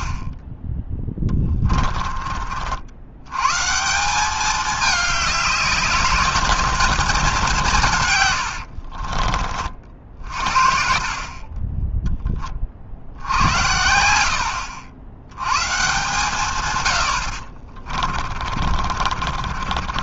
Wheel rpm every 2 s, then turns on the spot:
10, 60, 210, 220, 60, 50, 40, 70, 110, 30.
0-2 8-10 18-20